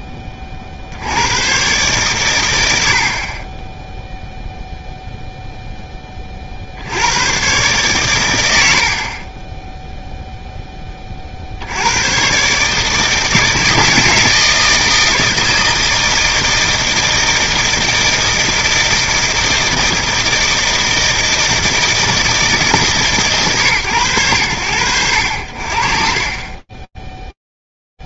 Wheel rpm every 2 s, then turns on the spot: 70, 50, 0, 120, 20, 70, 160, 160, 160, 160, 160, 130, 60, 0.
none